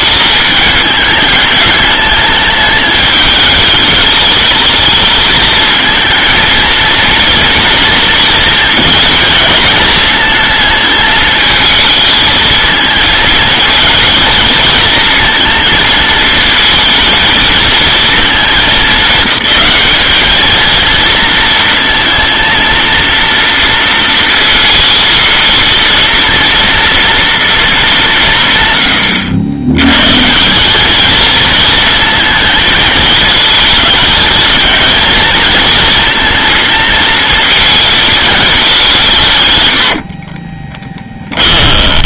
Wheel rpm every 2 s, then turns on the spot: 210, 210, 220, 230, 220, 220, 230, 230, 220, 210, 220, 230, 230, 230, 120, 210, 220, 220, 230, 190, 20.
40-42